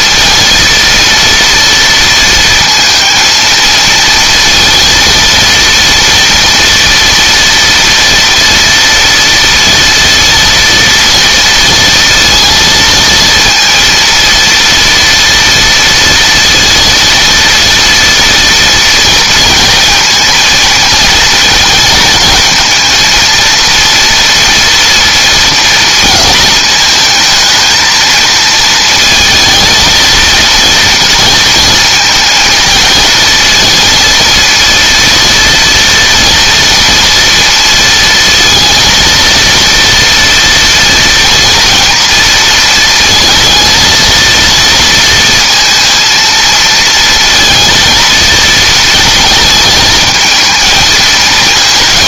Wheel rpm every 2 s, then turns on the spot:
230, 230, 230, 230, 230, 230, 230, 230, 230, 230, 230, 220, 230, 220, 230, 230, 220, 230, 230, 230, 230, 230, 230, 220, 230, 230.
none